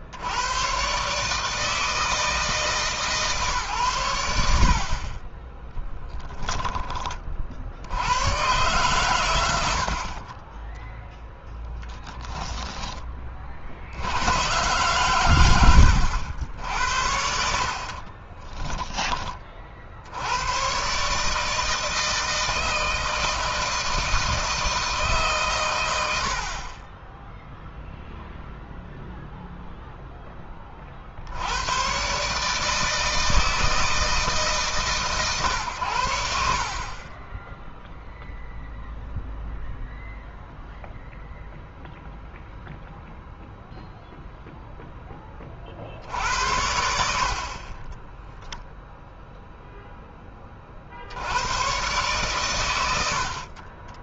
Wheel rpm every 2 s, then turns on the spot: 100, 160, 60, 10, 120, 20, 10, 110, 80, 20, 110, 160, 160, 40, 0, 20, 150, 150, 60, 0, 0, 0, 0, 80, 0, 30, 100.
18-20